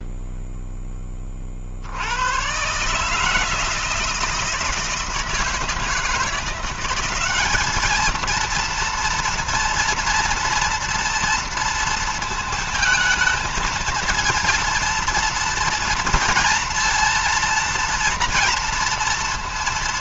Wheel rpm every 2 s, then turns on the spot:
10, 130, 160, 180, 230, 230, 220, 230, 230, 230.
none